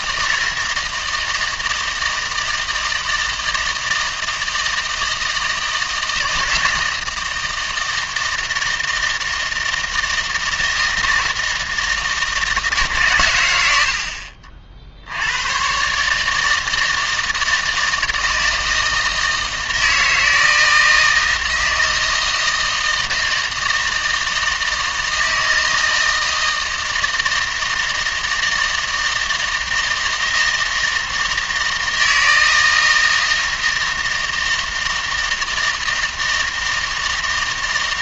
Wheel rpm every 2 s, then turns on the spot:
160, 160, 160, 160, 160, 160, 150, 70, 160, 160, 160, 160, 160, 160, 160, 160, 160, 160, 160.
none